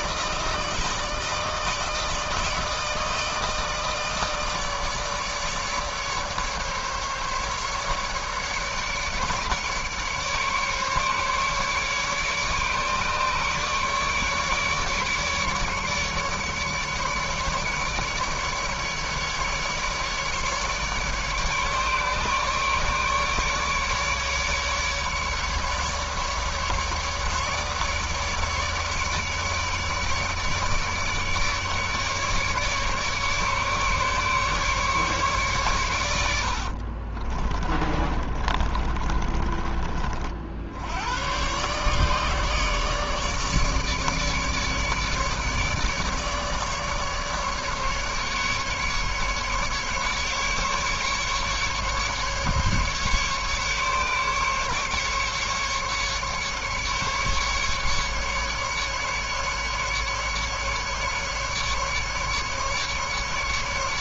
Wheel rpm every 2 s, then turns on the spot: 150, 160, 150, 150, 150, 150, 150, 150, 150, 150, 150, 150, 150, 150, 150, 150, 150, 140, 40, 30, 100, 150, 150, 150, 150, 140, 140, 150, 150, 150, 150, 140.
36-40